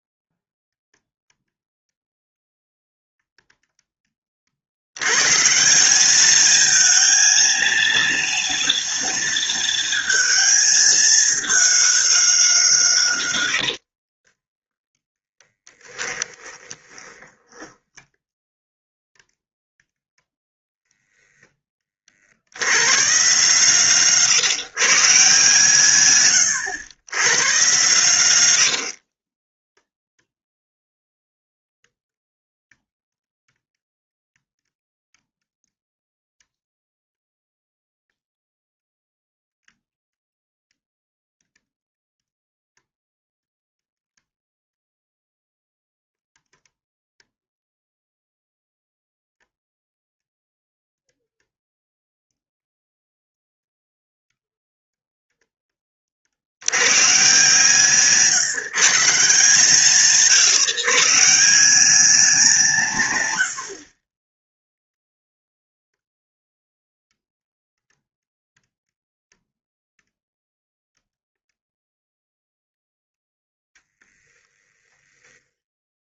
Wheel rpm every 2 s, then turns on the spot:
0, 0, 80, 220, 230, 220, 170, 10, 20, 0, 10, 110, 150, 110, 70, 0, 0, 0, 0, 0, 0, 0, 0, 0, 0, 0, 0, 0, 110, 160, 150, 160, 0, 0, 0, 0, 0, 10.
14-18 20-22 28-30 74-76